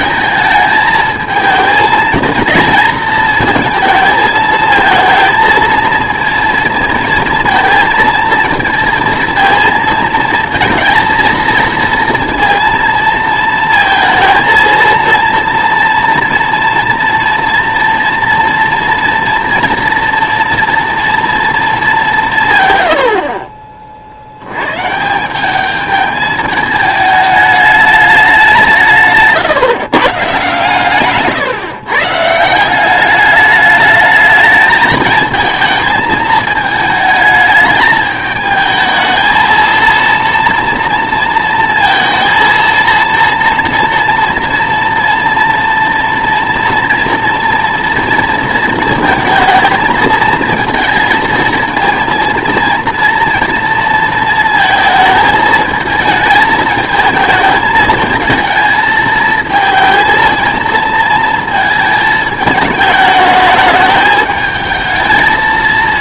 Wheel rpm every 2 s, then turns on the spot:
220, 220, 220, 230, 230, 230, 230, 230, 240, 230, 230, 110, 130, 210, 170, 140, 180, 220, 220, 220, 230, 230, 230, 230, 230, 230, 230, 230, 220, 220, 230, 210, 220.
none